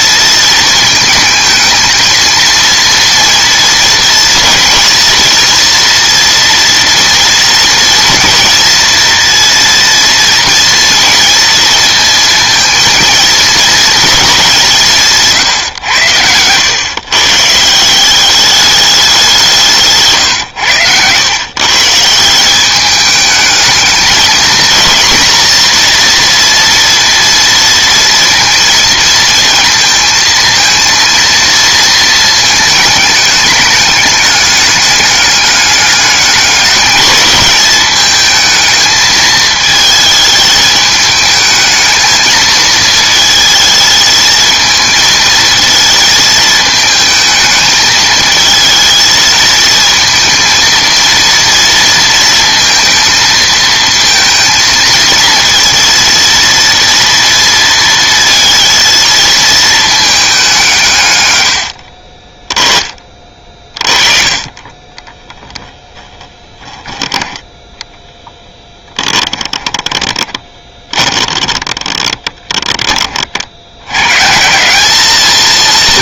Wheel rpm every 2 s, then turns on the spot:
220, 230, 230, 230, 230, 230, 220, 190, 110, 200, 120, 190, 230, 230, 230, 230, 220, 200, 210, 220, 210, 220, 220, 220, 230, 230, 230, 230, 230, 230, 180, 20, 30, 10, 10, 30, 10, 170.
66-72